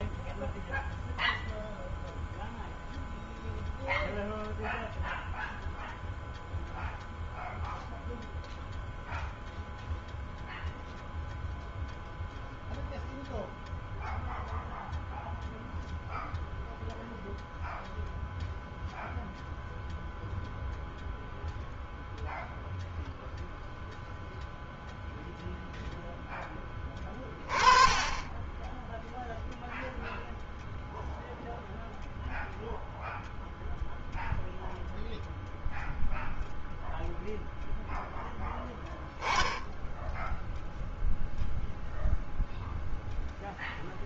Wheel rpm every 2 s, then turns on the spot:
0, 0, 0, 0, 0, 0, 0, 0, 0, 0, 0, 0, 0, 10, 10, 0, 0, 0, 0, 0, 0, 0.
none